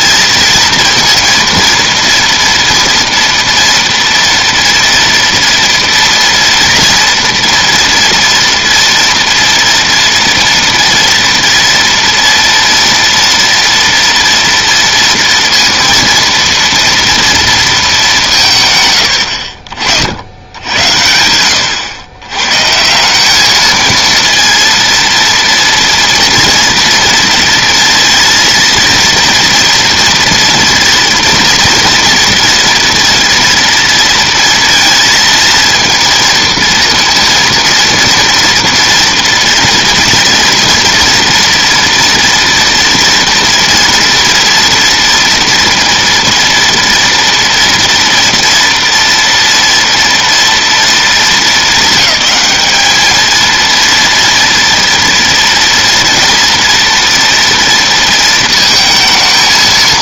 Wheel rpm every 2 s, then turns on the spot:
230, 230, 230, 240, 230, 230, 230, 230, 230, 110, 80, 170, 230, 230, 230, 230, 230, 230, 230, 230, 230, 230, 230, 230, 230, 230, 220, 230, 240, 220.
none